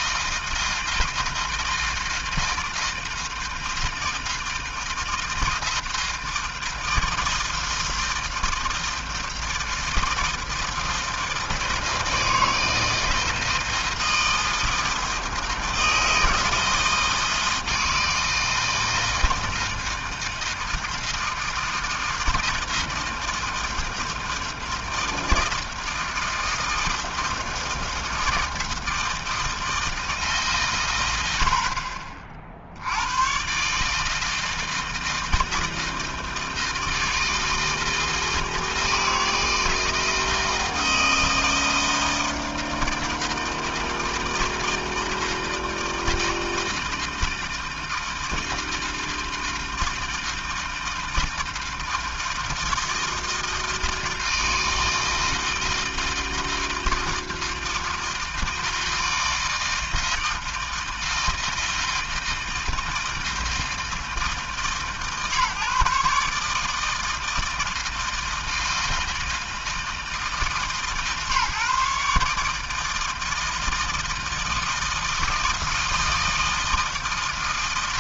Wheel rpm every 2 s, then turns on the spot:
160, 160, 160, 160, 160, 160, 160, 160, 160, 160, 160, 160, 160, 160, 160, 90, 100, 160, 160, 160, 160, 160, 160, 160, 160, 160, 160, 160, 160, 160, 160, 160, 150, 160, 160, 140, 160, 160, 160.
none